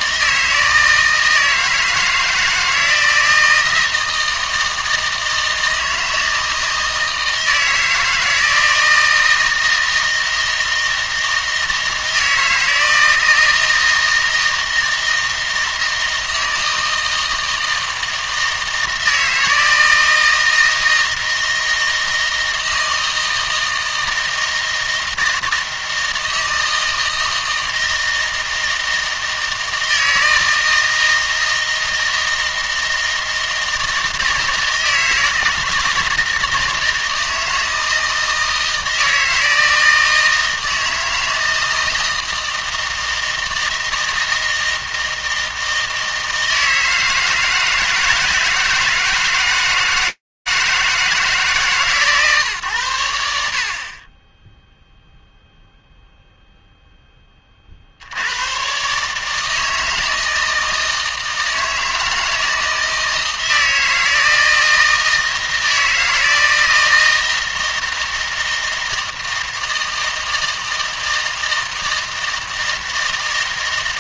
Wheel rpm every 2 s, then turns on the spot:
160, 160, 160, 160, 160, 160, 160, 160, 160, 160, 160, 160, 160, 160, 160, 160, 160, 160, 160, 160, 160, 160, 160, 160, 160, 160, 90, 0, 10, 140, 160, 160, 160, 160, 160, 160, 160.
none